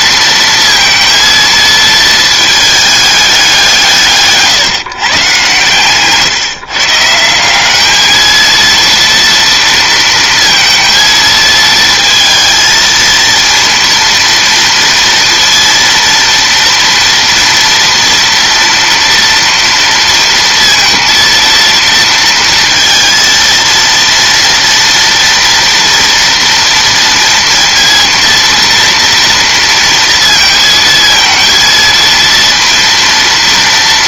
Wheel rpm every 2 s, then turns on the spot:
230, 220, 150, 140, 230, 230, 220, 230, 230, 230, 230, 230, 230, 230, 230, 230, 230.
none